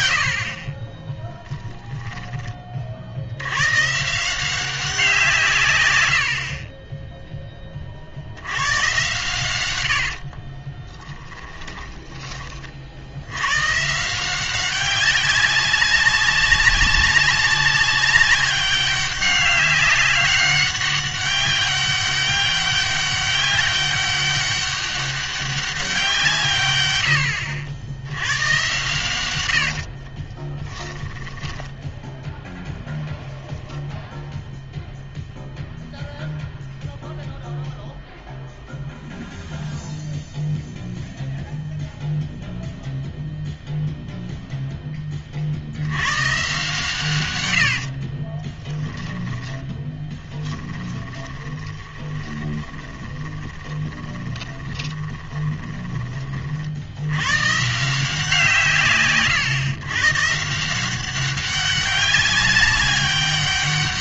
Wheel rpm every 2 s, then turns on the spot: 50, 30, 180, 40, 90, 30, 30, 190, 200, 200, 200, 200, 200, 130, 120, 10, 10, 0, 0, 0, 0, 0, 0, 120, 20, 10, 10, 20, 50, 170, 160, 200.
10-12 30-32 48-56